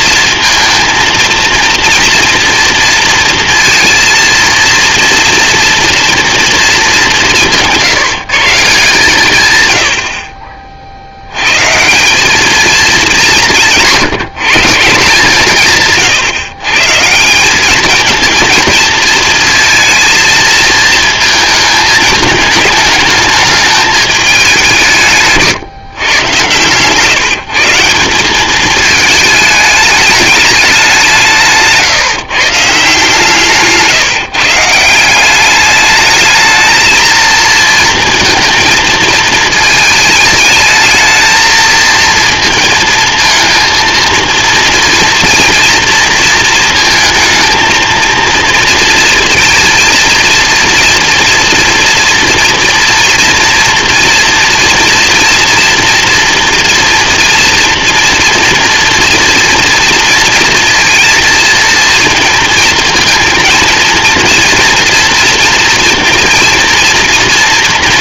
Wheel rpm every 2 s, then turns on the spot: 230, 230, 230, 220, 160, 50, 210, 160, 130, 230, 220, 210, 190, 120, 210, 210, 140, 150, 220, 220, 220, 230, 230, 230, 230, 230, 230, 240, 240, 240, 230, 230, 240, 230.
26-28